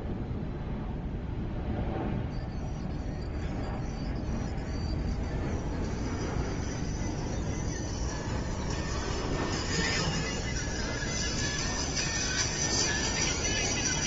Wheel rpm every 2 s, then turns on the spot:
0, 0, 0, 0, 0, 0, 0.
none